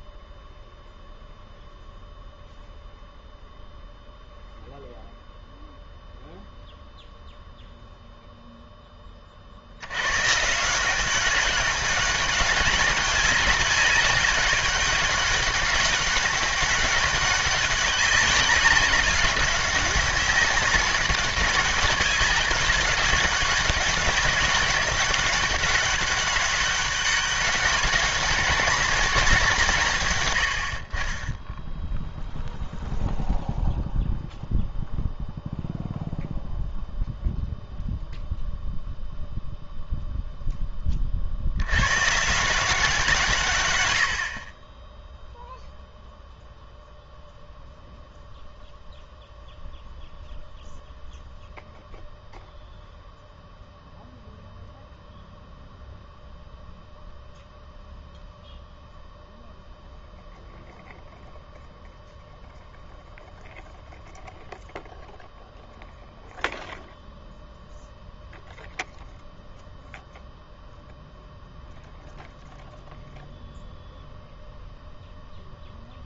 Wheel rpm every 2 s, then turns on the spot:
0, 0, 0, 0, 0, 160, 200, 200, 190, 190, 190, 200, 200, 190, 200, 70, 0, 0, 0, 0, 10, 170, 30, 0, 0, 0, 0, 0, 0, 0, 0, 0, 0, 0, 0, 0, 0, 0.
none